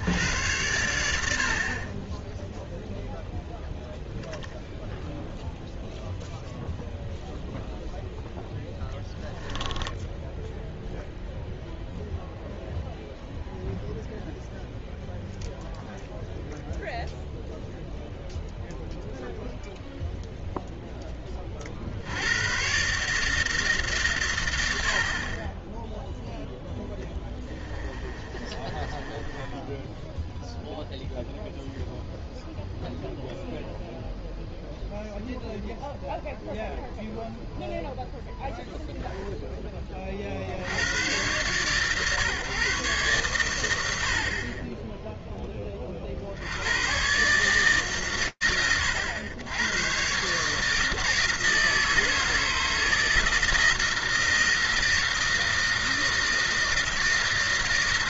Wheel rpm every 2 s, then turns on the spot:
90, 0, 0, 0, 0, 0, 0, 0, 0, 0, 0, 100, 110, 0, 30, 0, 0, 0, 0, 0, 40, 140, 40, 80, 90, 150, 160, 160, 160.
28-30